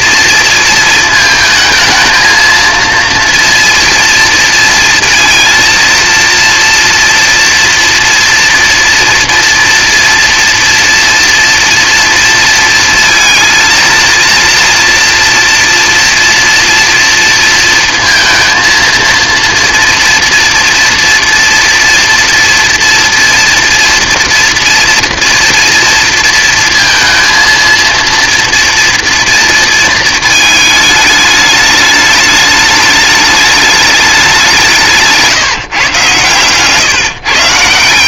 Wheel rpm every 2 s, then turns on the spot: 230, 230, 230, 230, 230, 230, 230, 230, 230, 230, 230, 230, 230, 230, 230, 210, 210, 180, 130.
none